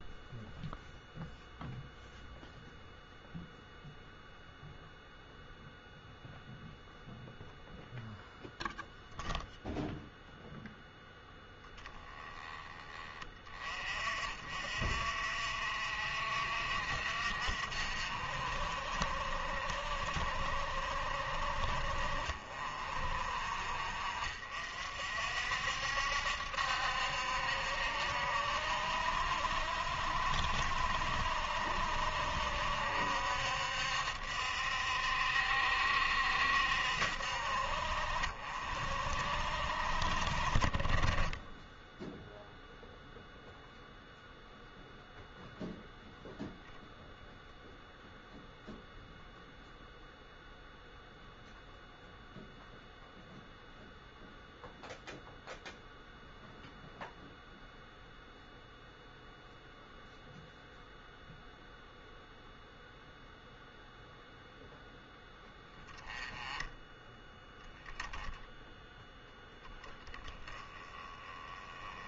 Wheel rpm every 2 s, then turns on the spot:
0, 0, 0, 0, 0, 0, 20, 50, 50, 50, 50, 50, 50, 70, 70, 60, 60, 60, 60, 50, 30, 0, 0, 0, 0, 0, 0, 0, 0, 0, 0, 0, 0, 10, 0, 10.
none